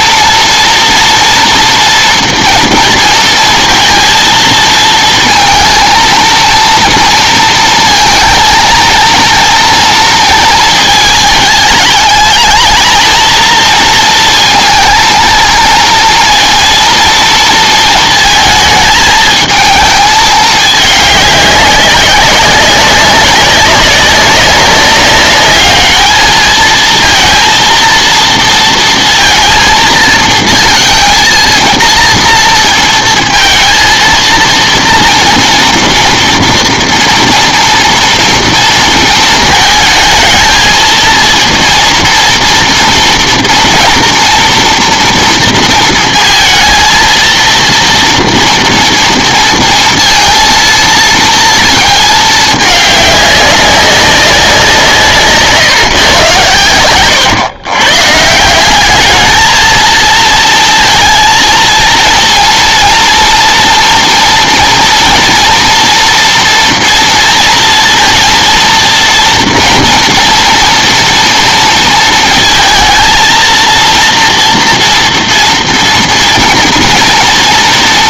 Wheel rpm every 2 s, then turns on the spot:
230, 230, 230, 230, 230, 220, 220, 230, 230, 220, 210, 190, 200, 220, 230, 230, 230, 230, 230, 230, 220, 230, 230, 230, 240, 230, 210, 180, 120, 180, 230, 230, 230, 240, 230, 240, 230, 240, 230.
none